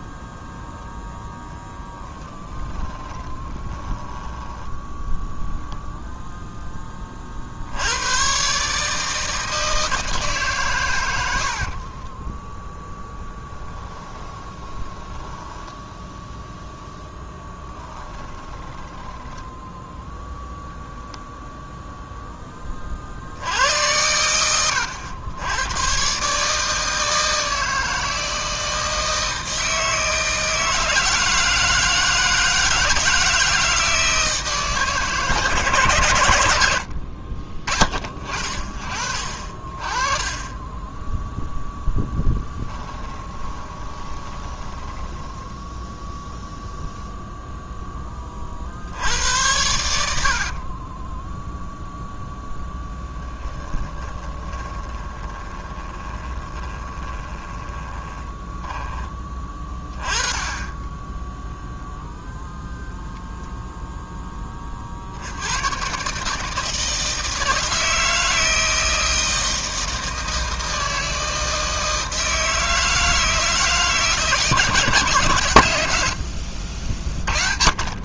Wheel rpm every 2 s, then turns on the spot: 10, 20, 10, 10, 140, 140, 10, 20, 0, 20, 0, 30, 100, 160, 160, 160, 160, 150, 80, 40, 10, 10, 20, 0, 70, 30, 10, 20, 20, 10, 10, 0, 40, 160, 160, 160, 160, 150, 50.
2-4 14-16 18-20 40-46 50-52 54-58